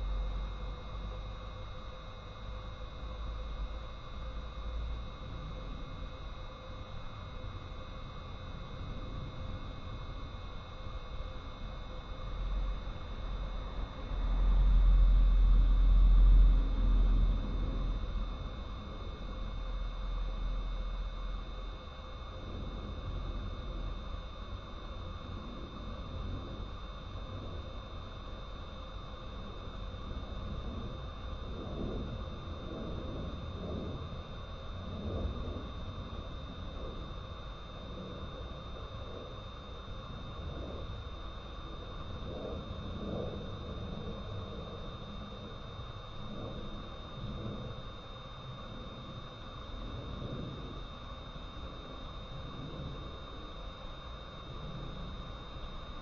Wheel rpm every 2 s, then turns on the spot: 0, 0, 0, 0, 0, 0, 0, 0, 0, 0, 0, 0, 0, 0, 0, 0, 0, 0, 0, 0, 0, 0, 0, 0, 0, 0, 0, 0.
none